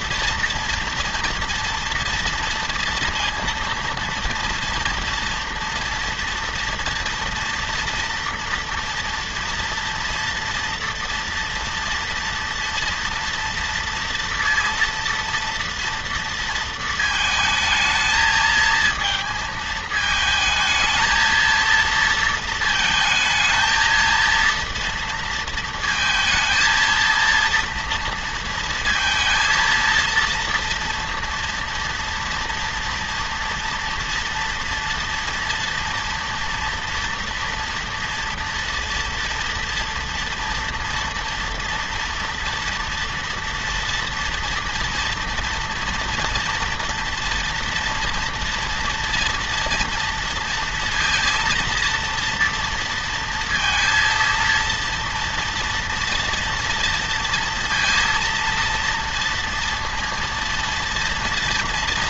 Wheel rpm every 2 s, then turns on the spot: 230, 230, 230, 230, 230, 230, 230, 230, 230, 220, 220, 230, 230, 220, 230, 230, 230, 230, 230, 230, 240, 230, 230, 230, 230, 230, 230, 230, 230, 230, 230.
none